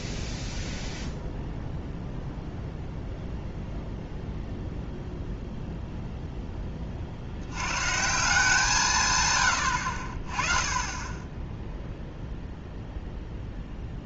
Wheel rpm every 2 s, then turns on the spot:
0, 0, 0, 20, 180, 20, 0.
none